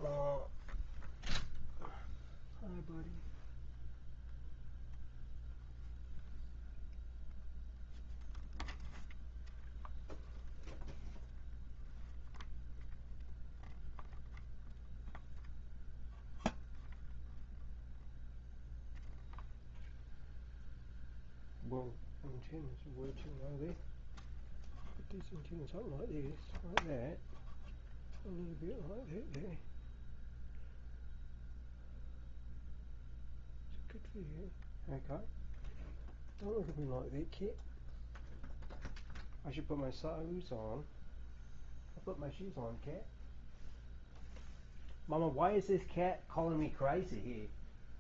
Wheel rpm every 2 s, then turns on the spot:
0, 0, 0, 0, 0, 0, 0, 0, 0, 0, 0, 0, 0, 0, 0, 0, 0, 0, 0, 0, 0, 0, 0, 0.
none